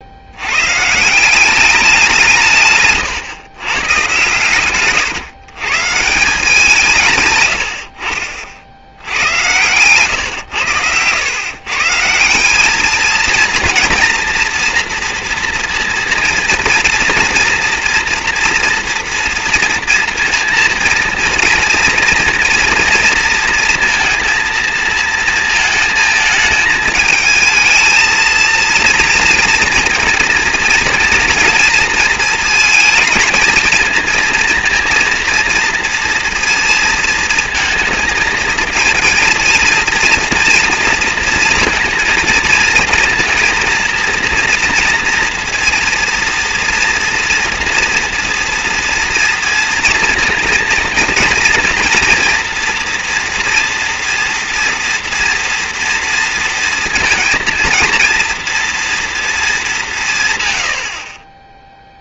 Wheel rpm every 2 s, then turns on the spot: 110, 140, 130, 180, 60, 100, 200, 230, 230, 230, 230, 240, 230, 220, 230, 230, 230, 230, 230, 230, 230, 230, 230, 230, 230, 230, 230, 230, 230, 230, 120.
none